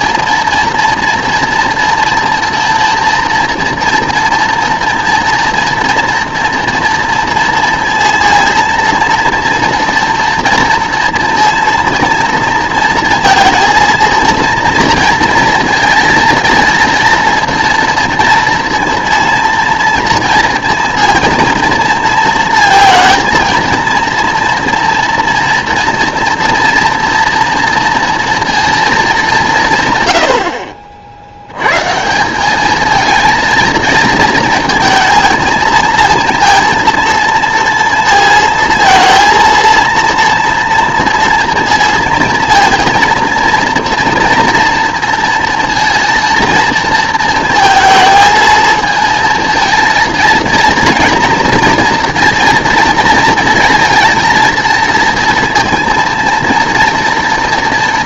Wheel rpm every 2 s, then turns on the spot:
230, 230, 230, 230, 230, 230, 230, 230, 230, 230, 230, 230, 240, 230, 230, 60, 220, 220, 230, 220, 240, 230, 230, 230, 230, 230, 230, 230, 230.
none